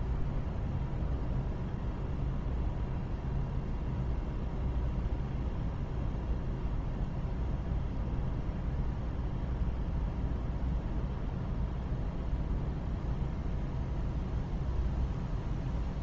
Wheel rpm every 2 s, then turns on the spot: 0, 0, 0, 0, 0, 0, 0, 0.
none